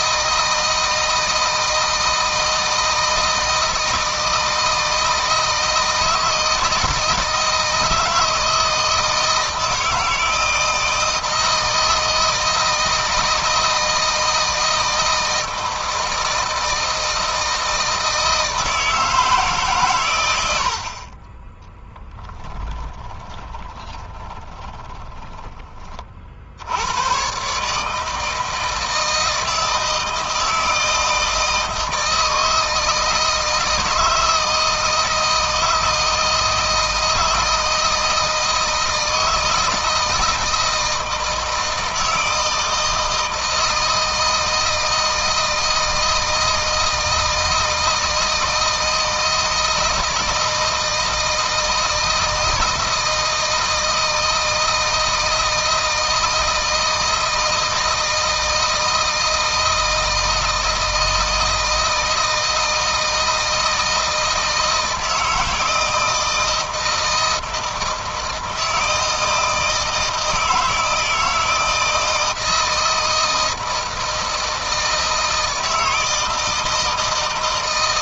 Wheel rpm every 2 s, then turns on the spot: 160, 160, 160, 160, 160, 160, 160, 160, 160, 160, 60, 20, 30, 90, 160, 160, 160, 160, 160, 160, 160, 160, 160, 160, 160, 160, 160, 170, 160, 160, 160, 160, 160, 160, 160, 160, 160, 160, 160.
22-26